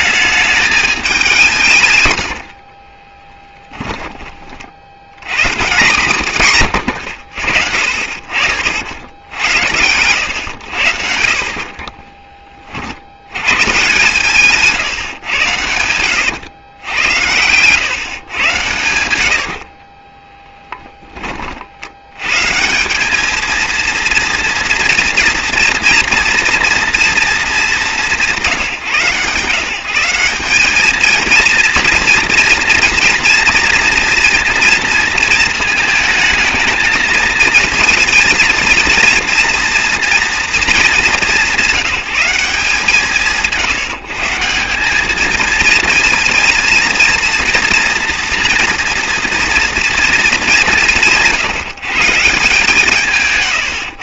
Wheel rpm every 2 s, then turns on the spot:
210, 50, 60, 110, 60, 90, 40, 150, 100, 110, 10, 160, 230, 230, 160, 200, 230, 230, 220, 230, 220, 170, 180, 230, 230, 190, 160.
2-4 14-16 20-22